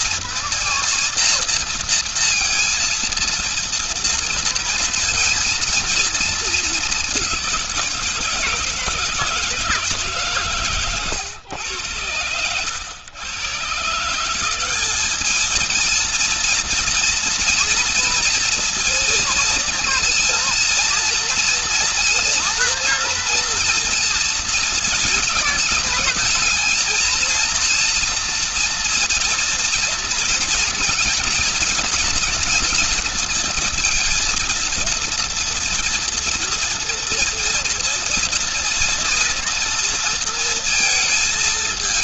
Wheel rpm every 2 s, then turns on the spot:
230, 230, 230, 210, 160, 130, 110, 200, 230, 230, 230, 230, 230, 230, 230, 230, 220, 230, 230, 230, 230.
none